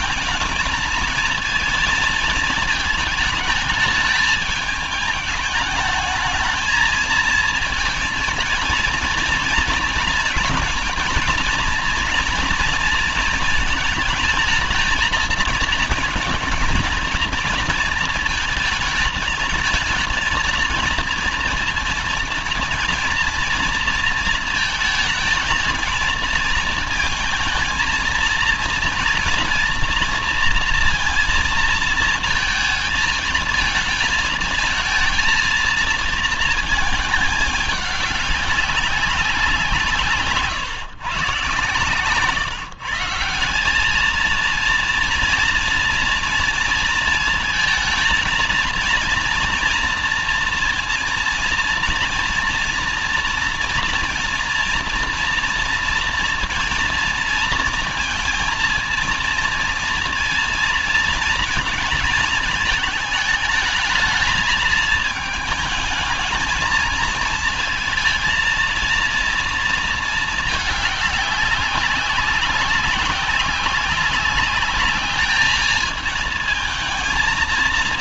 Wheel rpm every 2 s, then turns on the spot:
220, 220, 210, 220, 230, 230, 230, 220, 230, 220, 230, 230, 220, 220, 230, 230, 220, 220, 220, 190, 130, 180, 230, 230, 230, 230, 230, 230, 230, 230, 230, 220, 220, 230, 230, 200, 190, 210, 220.
none